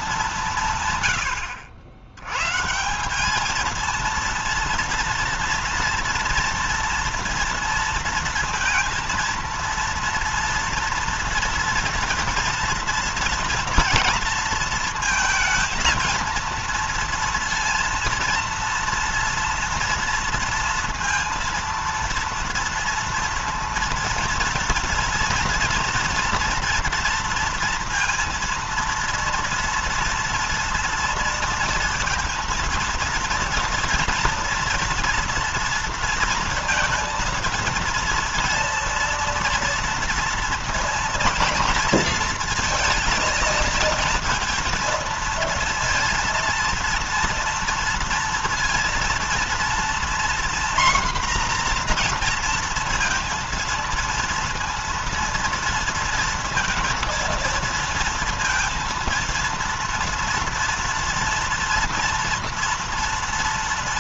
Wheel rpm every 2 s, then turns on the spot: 170, 150, 230, 230, 230, 230, 230, 230, 230, 230, 230, 230, 230, 230, 230, 230, 230, 230, 230, 230, 230, 230, 230, 230, 230, 250, 230, 230, 230, 230, 230, 230.
none